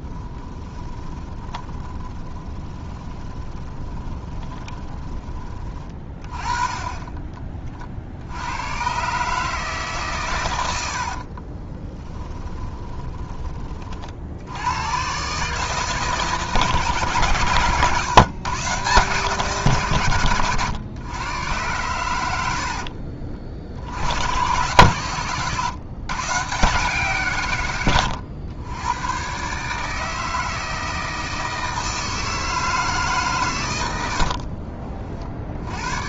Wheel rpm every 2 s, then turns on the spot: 20, 20, 10, 20, 120, 70, 20, 110, 140, 140, 120, 50, 120, 150, 110, 160, 150, 40.
0-6 10-14 22-24